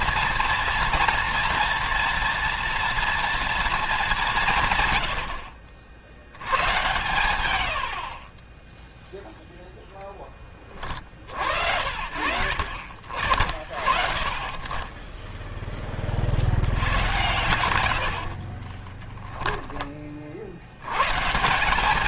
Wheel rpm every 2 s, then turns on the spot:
230, 230, 140, 110, 0, 40, 50, 20, 90, 20, 110.
18-20